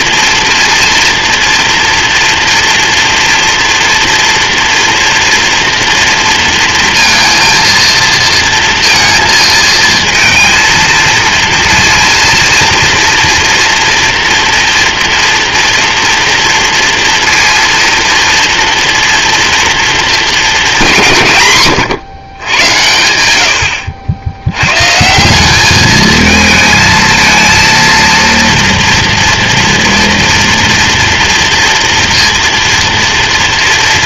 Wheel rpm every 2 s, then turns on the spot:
230, 230, 230, 230, 230, 230, 230, 230, 230, 230, 150, 100, 150, 220, 230, 230, 230.
none